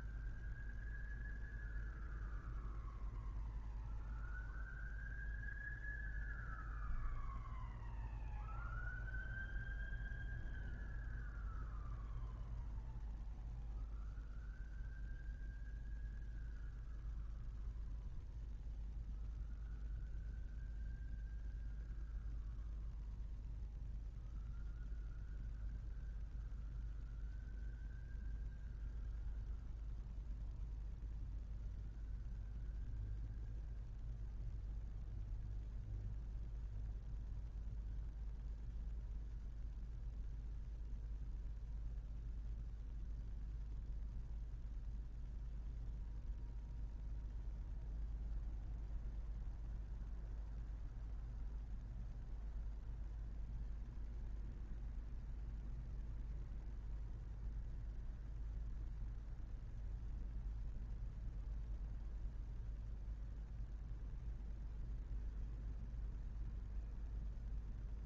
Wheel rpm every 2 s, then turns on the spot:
0, 0, 0, 0, 0, 0, 0, 0, 0, 0, 0, 0, 0, 0, 0, 0, 0, 0, 0, 0, 0, 0, 0, 0, 0, 0, 0, 0, 0, 0, 0, 0, 0, 0.
none